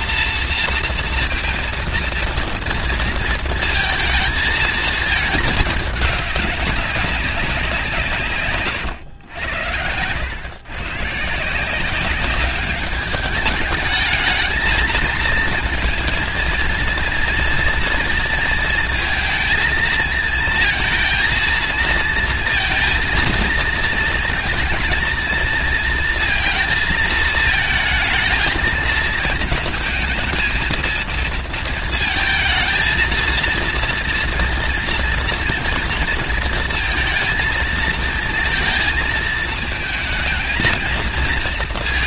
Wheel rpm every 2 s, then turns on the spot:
230, 230, 220, 200, 130, 120, 200, 220, 230, 230, 230, 230, 230, 220, 220, 230, 220, 230, 230, 230, 220.
none